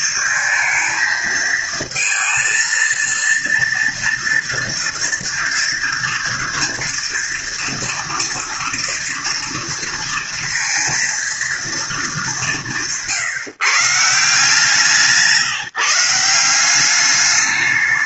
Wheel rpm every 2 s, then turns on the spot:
230, 220, 230, 230, 230, 230, 190, 160, 170.
none